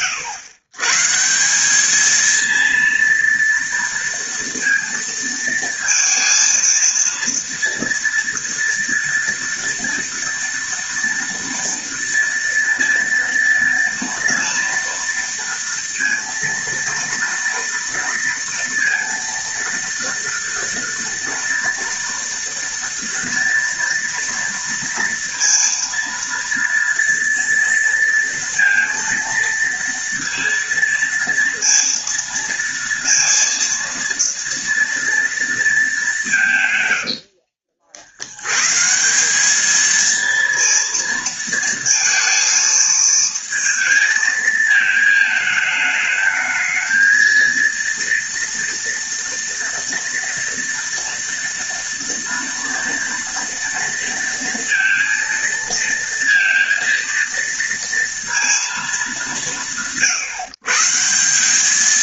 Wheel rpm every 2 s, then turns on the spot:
120, 230, 230, 230, 230, 230, 240, 230, 230, 230, 230, 240, 230, 230, 230, 230, 230, 230, 100, 150, 230, 220, 220, 230, 230, 230, 230, 230, 230, 190, 160.
36-38